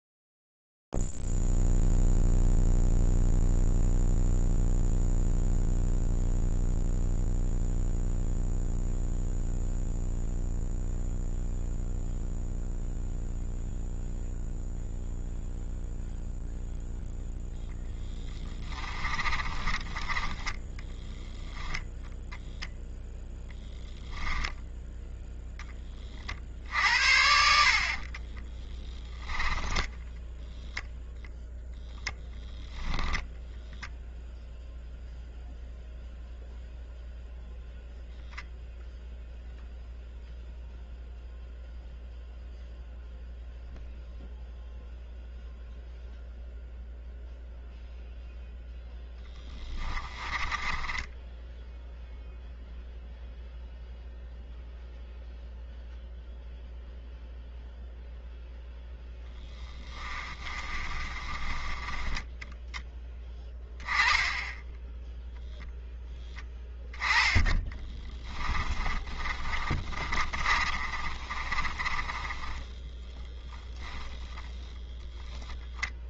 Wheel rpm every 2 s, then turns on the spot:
0, 0, 0, 0, 0, 0, 0, 0, 0, 20, 10, 0, 10, 50, 20, 0, 20, 0, 0, 0, 0, 0, 0, 0, 0, 20, 0, 0, 0, 0, 30, 10, 10, 10, 30, 30, 20, 10.
18-20 24-26 28-30 50-52 60-62 68-76